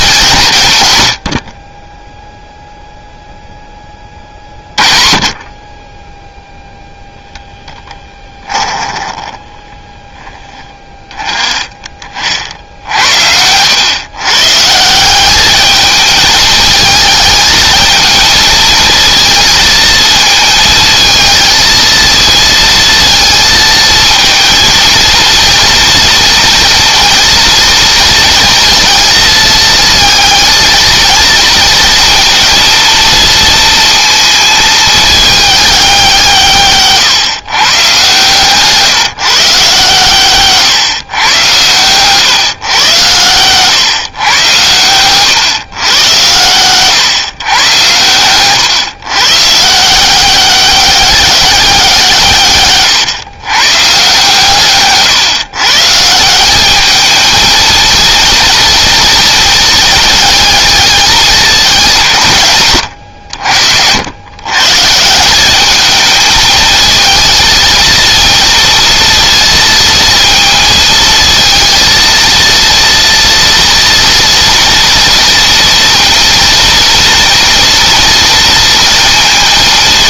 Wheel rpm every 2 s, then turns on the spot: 40, 0, 50, 0, 10, 20, 80, 180, 220, 230, 230, 230, 230, 230, 230, 230, 230, 220, 130, 150, 120, 110, 120, 130, 130, 190, 130, 140, 220, 230, 220, 100, 150, 220, 230, 220, 230, 230, 230, 230.
8-10